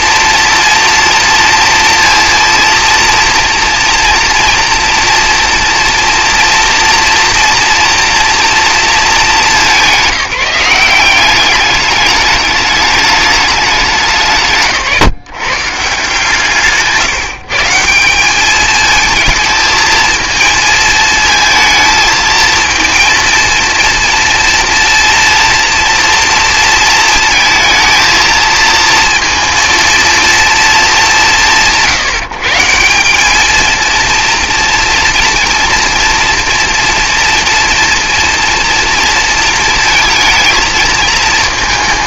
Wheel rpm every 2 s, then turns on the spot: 240, 230, 230, 240, 220, 180, 210, 160, 150, 220, 220, 230, 230, 230, 230, 190, 160, 230, 230, 230, 230.
none